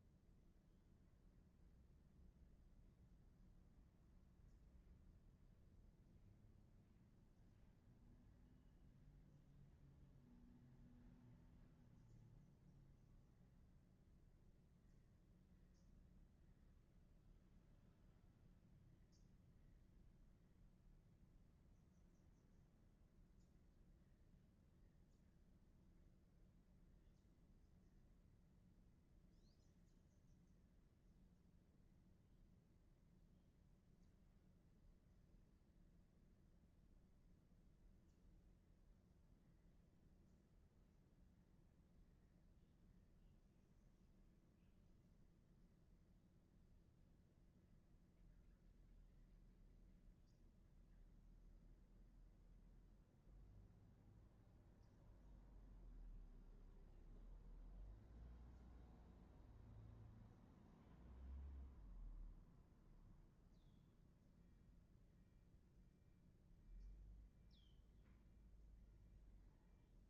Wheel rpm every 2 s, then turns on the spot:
0, 0, 0, 0, 0, 0, 0, 0, 0, 0, 0, 0, 0, 0, 0, 0, 0, 0, 0, 0, 0, 0, 0, 0, 0, 0, 0, 0, 0, 0, 0, 0, 0, 0, 0.
none